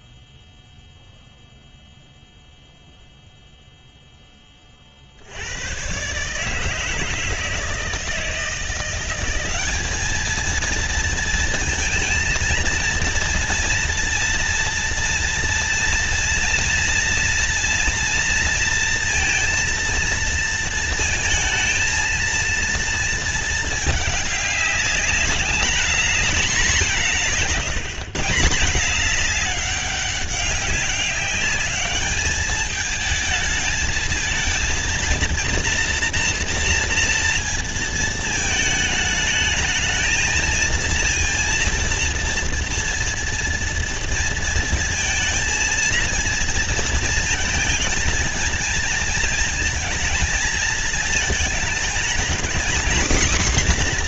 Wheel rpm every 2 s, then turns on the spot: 0, 0, 20, 150, 170, 220, 230, 230, 230, 230, 230, 230, 210, 190, 180, 200, 210, 220, 230, 220, 230, 230, 230, 230, 220, 220, 240.
none